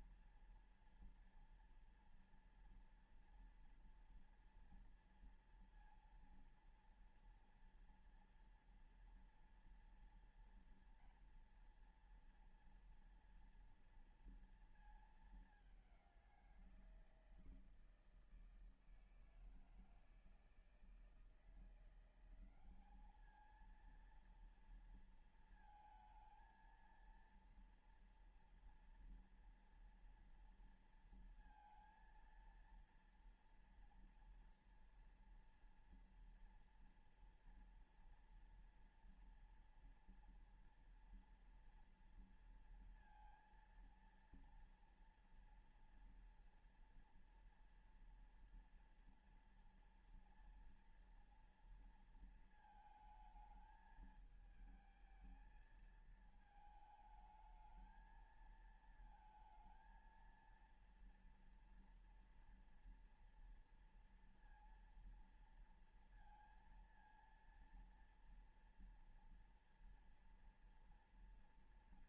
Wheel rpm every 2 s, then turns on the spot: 230, 230, 230, 230, 230, 230, 230, 230, 180, 160, 160, 190, 230, 230, 230, 230, 230, 230, 230, 230, 240, 230, 230, 230, 240, 230, 220, 220, 220, 220, 230, 240, 230, 230, 230, 230.
none